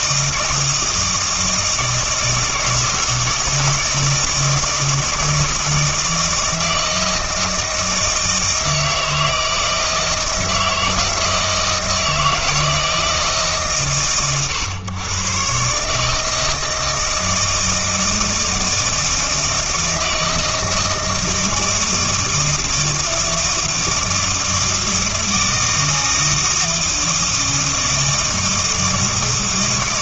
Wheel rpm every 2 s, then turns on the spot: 160, 160, 160, 160, 160, 160, 160, 120, 160, 160, 160, 160, 160, 160, 160.
none